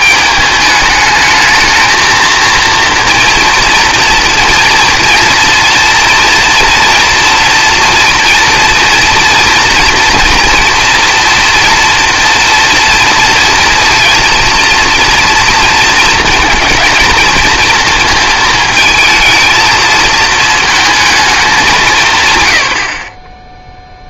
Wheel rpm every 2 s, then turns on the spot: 210, 230, 230, 230, 230, 230, 230, 230, 220, 220, 220, 100.
none